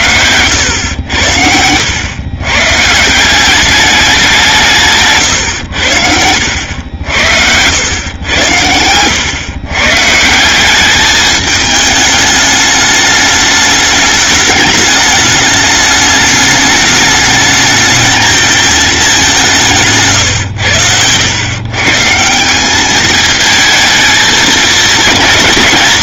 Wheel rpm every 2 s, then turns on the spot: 100, 150, 160, 90, 100, 200, 210, 210, 210, 210, 90, 200, 220.
0-2 4-8